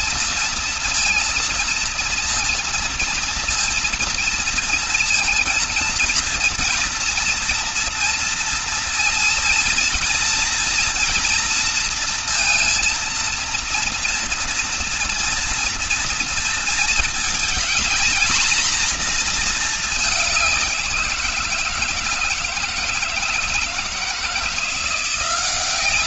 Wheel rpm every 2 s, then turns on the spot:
230, 230, 230, 230, 230, 240, 230, 230, 230, 230, 180, 160, 170.
none